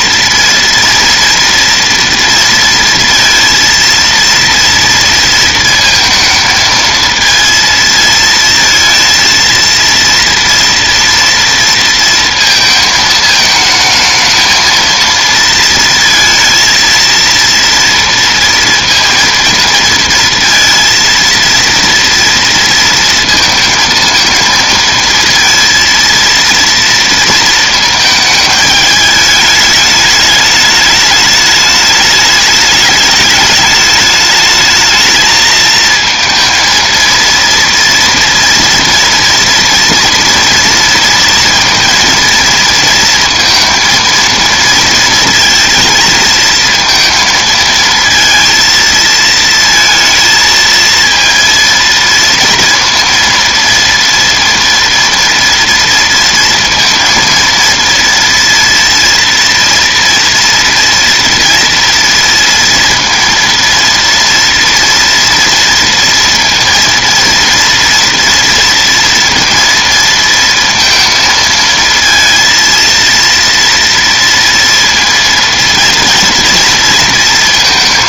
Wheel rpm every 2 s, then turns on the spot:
230, 230, 230, 220, 230, 240, 230, 220, 230, 230, 230, 230, 230, 230, 220, 210, 210, 220, 230, 230, 230, 230, 230, 230, 220, 230, 230, 230, 230, 230, 230, 230, 230, 230, 230, 230, 230, 230, 230.
none